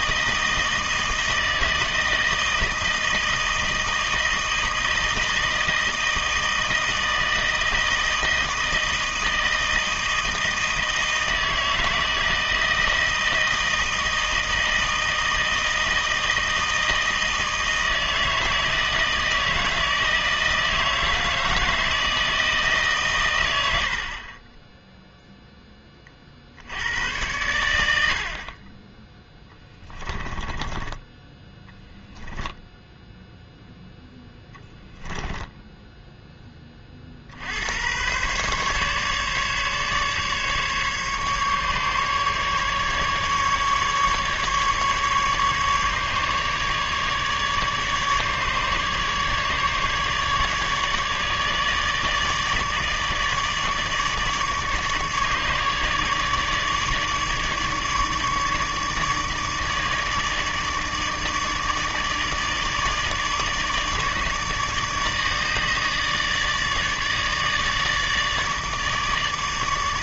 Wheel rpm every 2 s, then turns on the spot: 160, 160, 160, 160, 160, 160, 160, 160, 160, 160, 160, 150, 10, 80, 30, 20, 0, 10, 30, 140, 140, 140, 140, 150, 150, 150, 150, 150, 150, 150, 150, 150, 150, 150, 150.
30-32 34-36